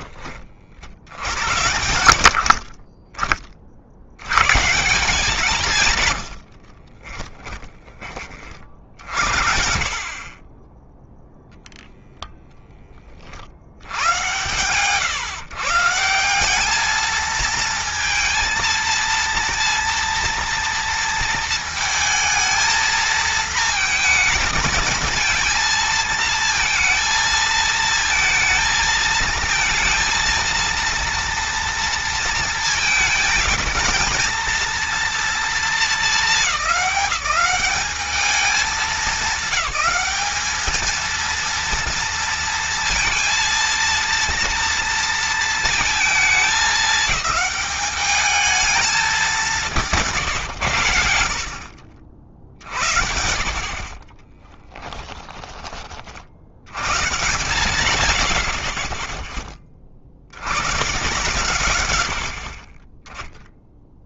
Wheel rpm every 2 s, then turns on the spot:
60, 40, 170, 50, 50, 10, 10, 130, 210, 230, 230, 220, 220, 220, 220, 230, 220, 230, 180, 210, 230, 230, 230, 210, 220, 110, 60, 10, 100, 20, 130, 20.
6-8 54-56